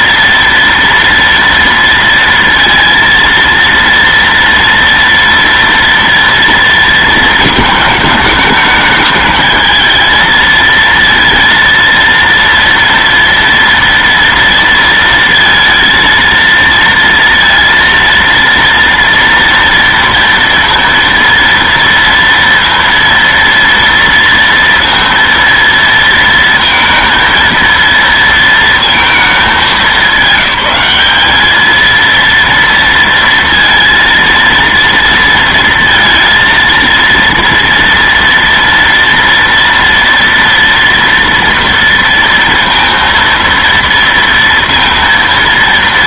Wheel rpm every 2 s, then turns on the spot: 230, 230, 230, 230, 210, 220, 230, 230, 230, 230, 230, 230, 230, 230, 230, 200, 230, 230, 230, 230, 230, 230, 230.
none